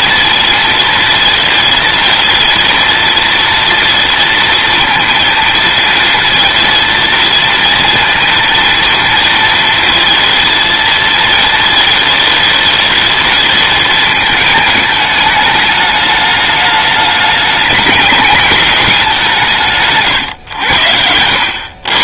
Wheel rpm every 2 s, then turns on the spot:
230, 230, 230, 230, 230, 230, 220, 210, 210, 200, 90.
none